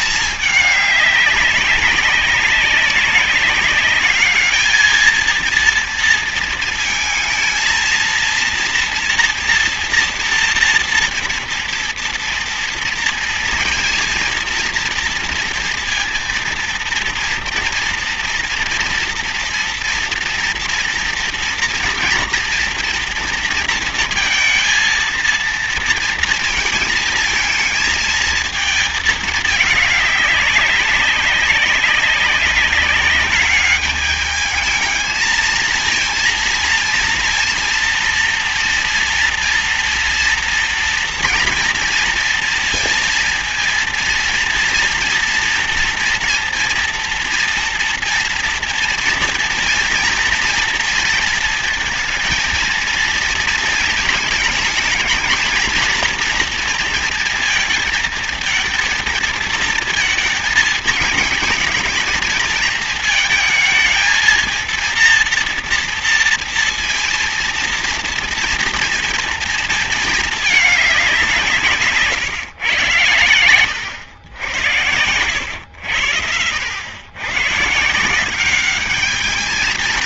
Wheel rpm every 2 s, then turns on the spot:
210, 190, 220, 220, 230, 230, 230, 230, 230, 230, 230, 240, 230, 230, 220, 200, 200, 220, 230, 230, 230, 230, 230, 230, 230, 230, 230, 220, 230, 230, 220, 220, 230, 230, 240, 210, 120, 90, 90, 200.
none